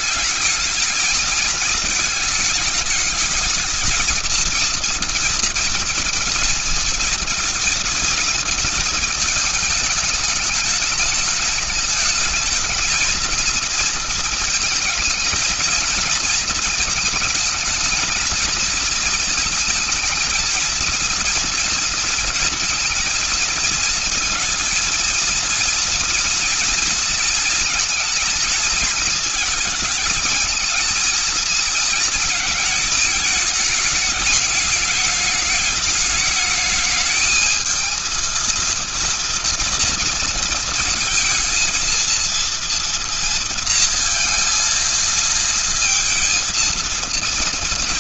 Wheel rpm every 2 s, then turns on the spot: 220, 220, 230, 230, 220, 210, 230, 220, 220, 220, 230, 230, 230, 230, 230, 230, 220, 210, 220, 230, 230, 230, 220, 230.
none